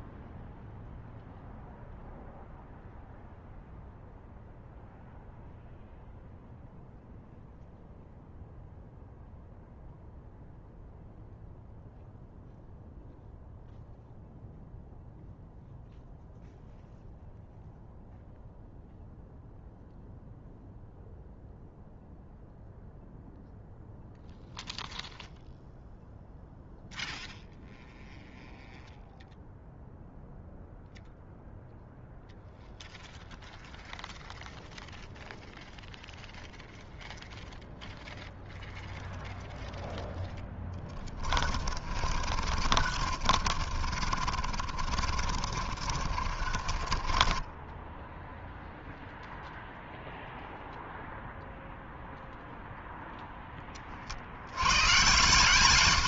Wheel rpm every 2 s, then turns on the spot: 0, 0, 0, 0, 0, 0, 0, 0, 0, 0, 0, 0, 0, 0, 0, 0, 0, 0, 0, 0, 10, 40, 40, 40, 0, 0, 0, 80.
40-48